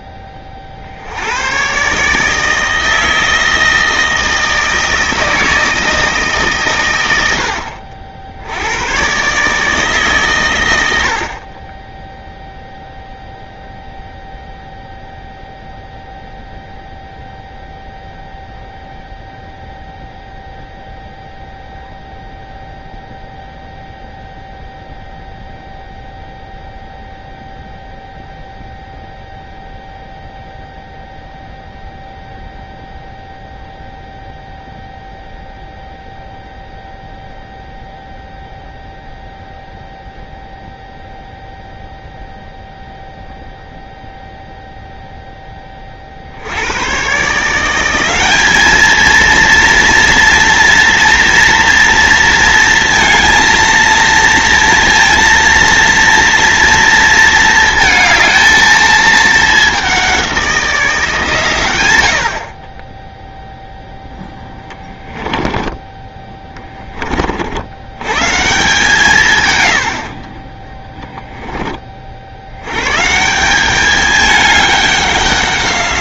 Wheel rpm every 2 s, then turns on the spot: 60, 160, 160, 120, 100, 110, 0, 0, 0, 0, 0, 0, 0, 0, 0, 0, 0, 0, 0, 0, 0, 0, 0, 100, 220, 240, 230, 230, 230, 220, 170, 30, 10, 20, 150, 20, 110, 200.
64-66 70-72